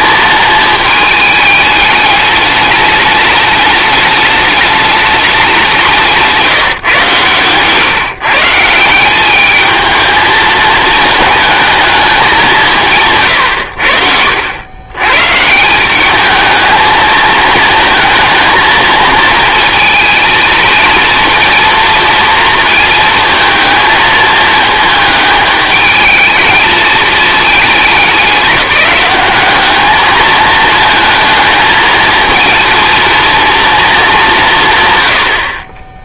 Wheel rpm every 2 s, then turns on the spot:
220, 210, 210, 150, 150, 220, 180, 80, 220, 230, 220, 230, 220, 220, 200, 220, 230, 140.
none